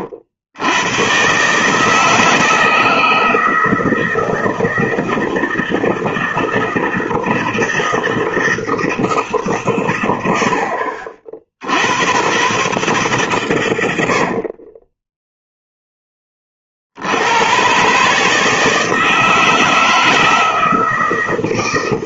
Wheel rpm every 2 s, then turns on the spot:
100, 160, 160, 160, 160, 80, 120, 40, 40, 160, 160.
14-16